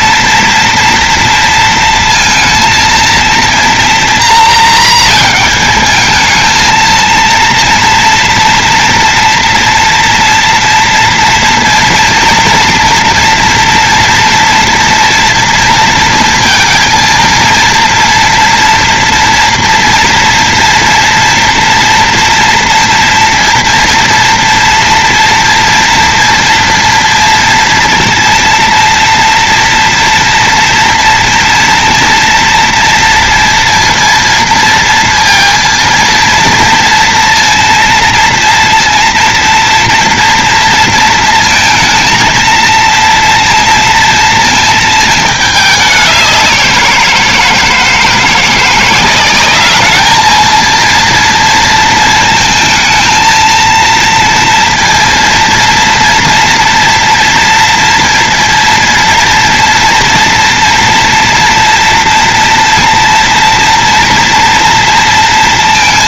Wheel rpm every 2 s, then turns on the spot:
230, 230, 230, 220, 230, 230, 230, 230, 230, 230, 230, 230, 240, 230, 230, 230, 230, 230, 230, 230, 230, 230, 230, 180, 170, 230, 220, 230, 230, 230, 240, 230, 240.
none